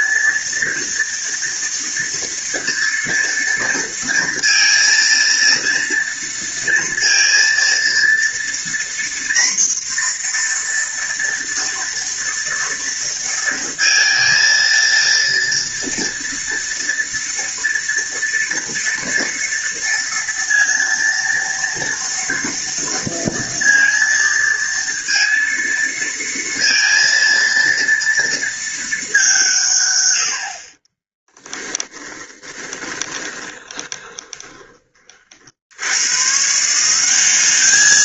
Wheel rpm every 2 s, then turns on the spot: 230, 230, 230, 230, 240, 230, 230, 230, 230, 230, 230, 230, 230, 230, 190, 30, 20, 30, 180.
30-34